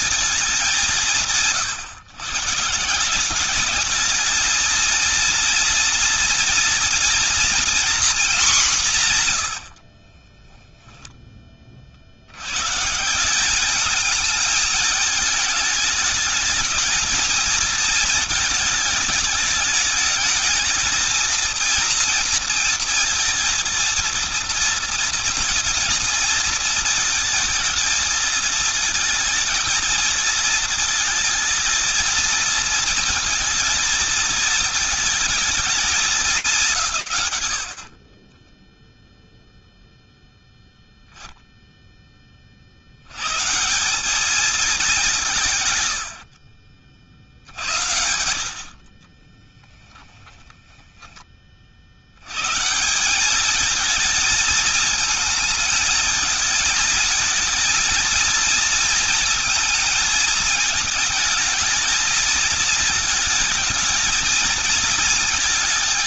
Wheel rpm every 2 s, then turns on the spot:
200, 170, 230, 240, 190, 10, 150, 210, 220, 220, 220, 230, 230, 220, 220, 220, 230, 220, 160, 0, 0, 100, 200, 80, 40, 20, 200, 220, 220, 230, 220, 230, 230.
10-12 48-50